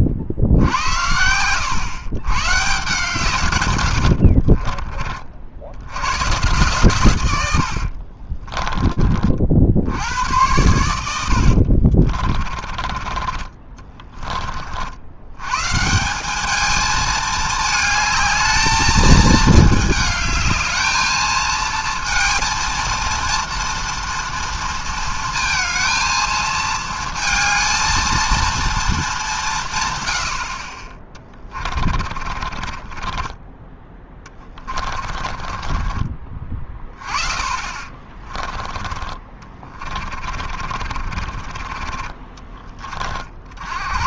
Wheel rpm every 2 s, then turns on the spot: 70, 130, 60, 120, 20, 100, 40, 40, 210, 220, 220, 230, 230, 220, 230, 50, 30, 30, 30, 20, 40, 30.
4-6 8-10 12-14 32-36 40-42